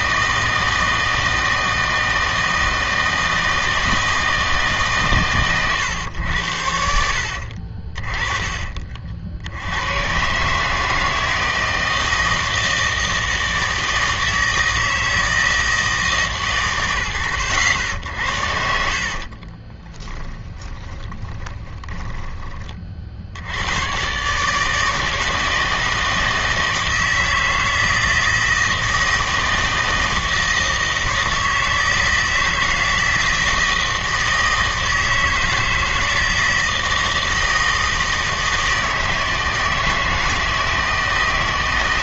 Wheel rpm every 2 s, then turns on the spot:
160, 160, 150, 80, 40, 150, 160, 160, 110, 70, 10, 40, 150, 160, 160, 160, 160, 160, 160, 160, 160.
18-22